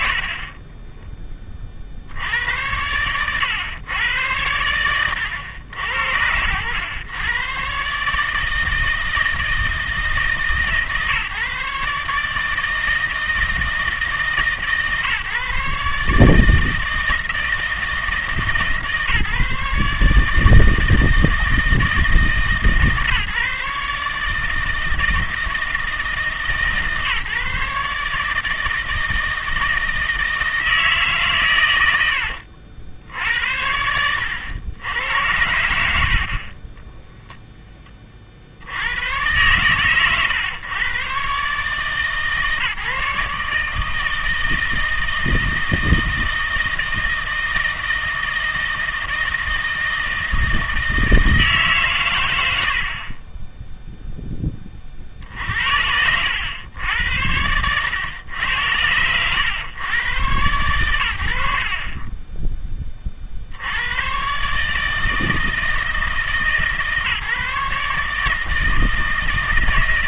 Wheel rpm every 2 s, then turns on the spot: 40, 100, 100, 100, 160, 150, 160, 140, 160, 150, 160, 150, 160, 150, 160, 160, 80, 90, 20, 80, 120, 140, 160, 160, 160, 160, 70, 40, 90, 100, 100, 20, 150, 150, 160.
none